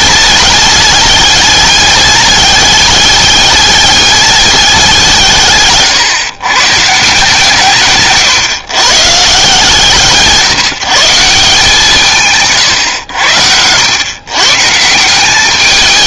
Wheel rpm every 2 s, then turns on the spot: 200, 210, 190, 150, 140, 160, 130, 160.
none